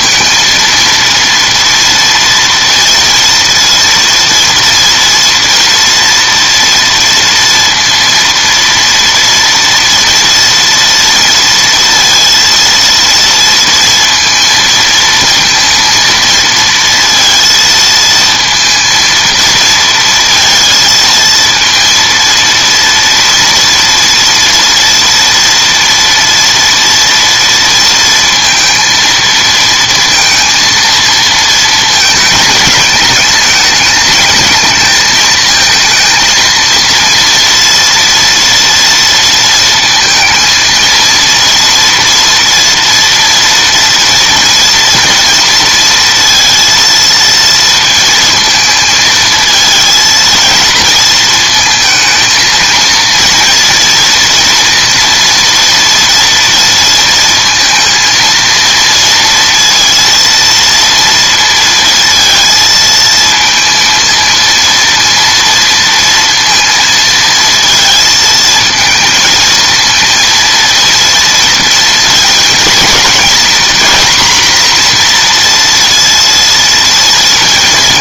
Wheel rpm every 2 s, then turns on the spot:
230, 230, 230, 230, 230, 230, 230, 220, 230, 230, 230, 230, 230, 230, 230, 230, 210, 220, 230, 230, 230, 240, 230, 230, 220, 230, 230, 230, 230, 230, 230, 220, 230, 230, 230, 230, 230, 240, 230.
none